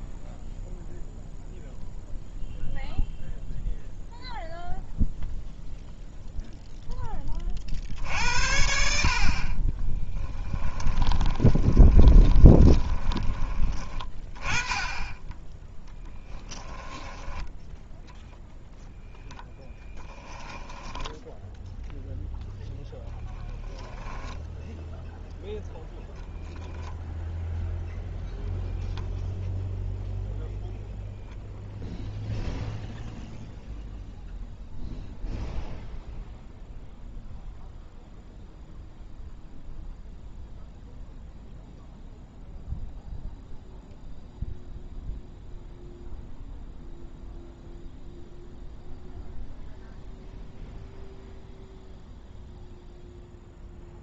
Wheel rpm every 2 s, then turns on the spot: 0, 0, 0, 0, 60, 10, 20, 20, 10, 0, 10, 10, 0, 0, 0, 0, 0, 0, 0, 0, 0, 0, 0, 0, 0, 0, 0.
10-14 20-22